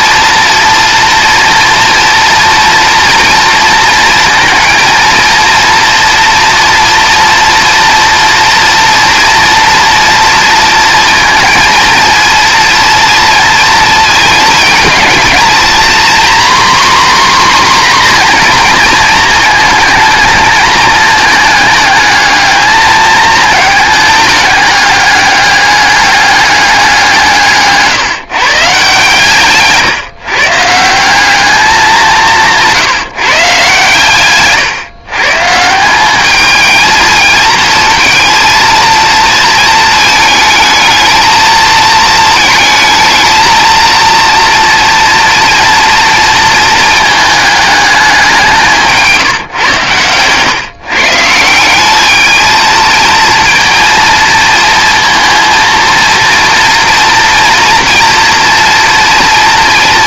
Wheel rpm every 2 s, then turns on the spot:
230, 240, 230, 230, 240, 230, 230, 230, 260, 230, 220, 220, 200, 180, 150, 160, 180, 140, 220, 230, 220, 220, 230, 220, 180, 130, 220, 230, 230, 230.
none